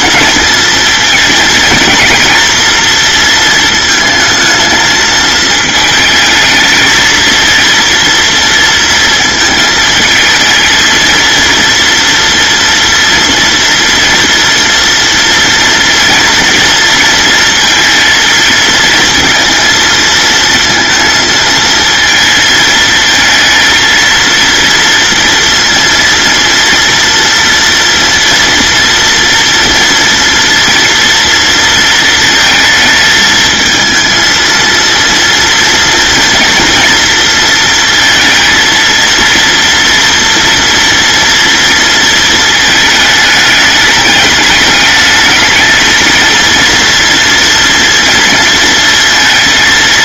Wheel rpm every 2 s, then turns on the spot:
230, 230, 220, 230, 230, 230, 230, 230, 230, 230, 230, 230, 230, 230, 230, 240, 220, 230, 230, 230, 230, 210, 210, 230, 230.
none